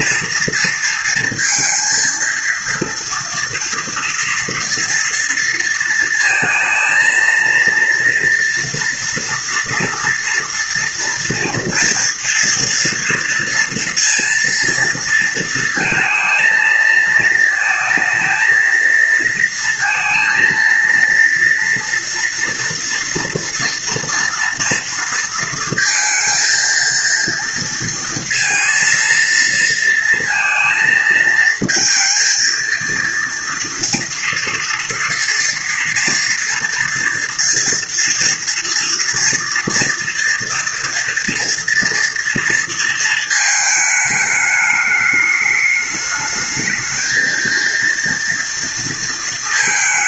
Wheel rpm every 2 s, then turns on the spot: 230, 230, 240, 220, 230, 230, 230, 230, 220, 230, 230, 240, 230, 230, 230, 230, 230, 240, 230, 230, 230, 230, 210, 220, 230.
none